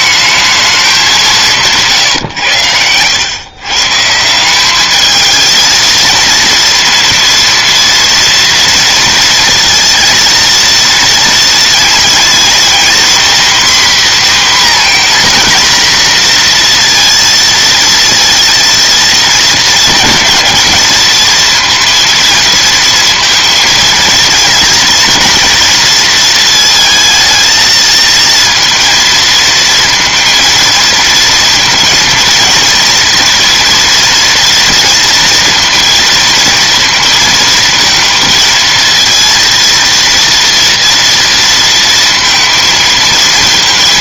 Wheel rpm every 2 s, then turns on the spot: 210, 90, 200, 230, 230, 230, 240, 250, 240, 230, 230, 230, 220, 220, 230, 230, 230, 230, 230, 220, 230, 230.
none